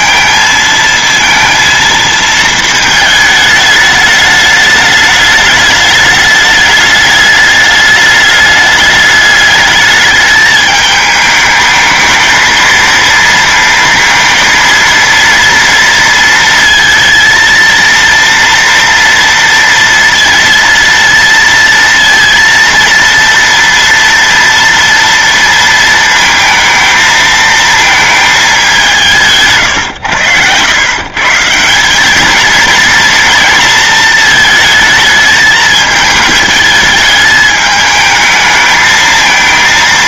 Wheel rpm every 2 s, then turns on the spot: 230, 220, 210, 210, 210, 210, 230, 230, 230, 230, 230, 230, 230, 220, 200, 110, 220, 220, 210, 220.
none